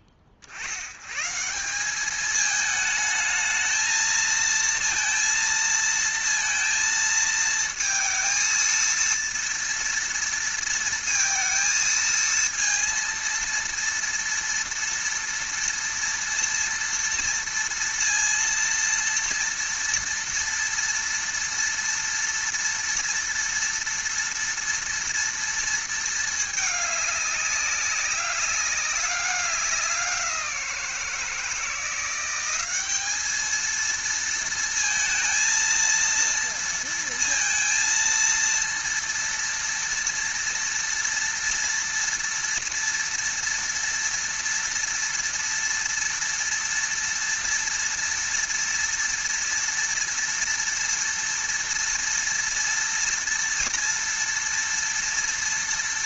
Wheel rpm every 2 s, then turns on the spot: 50, 220, 230, 230, 230, 230, 230, 230, 230, 230, 240, 230, 230, 210, 200, 180, 190, 230, 230, 230, 230, 230, 230, 230, 230, 230, 230, 230.
none